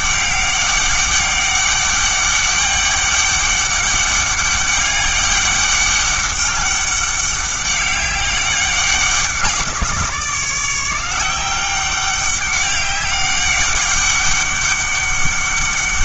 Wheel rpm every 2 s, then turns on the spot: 200, 200, 200, 200, 200, 170, 200, 200.
none